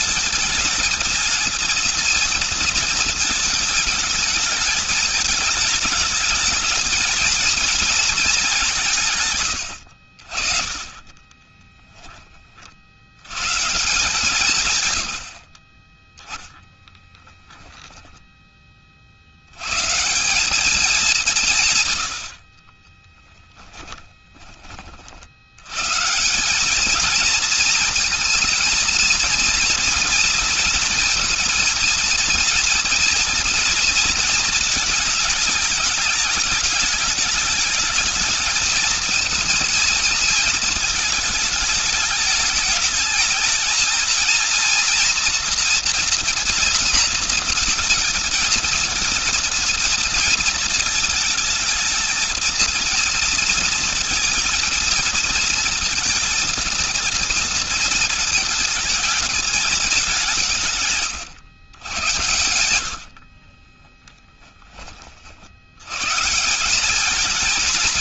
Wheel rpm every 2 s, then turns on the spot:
230, 230, 220, 210, 220, 60, 20, 150, 10, 20, 200, 40, 20, 190, 230, 230, 230, 220, 210, 220, 220, 210, 230, 230, 220, 220, 230, 230, 230, 220, 150, 100, 30, 170.
22-24 60-66